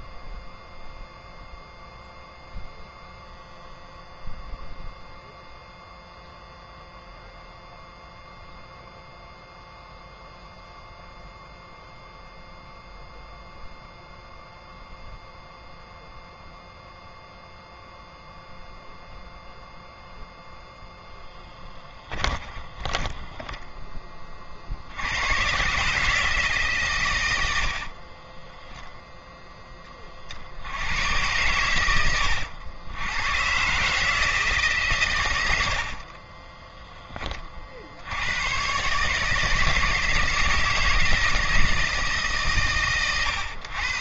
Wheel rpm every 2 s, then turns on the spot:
0, 0, 0, 0, 0, 0, 0, 0, 0, 0, 0, 10, 50, 140, 10, 70, 90, 150, 30, 120, 160, 140.
22-24 28-30 36-38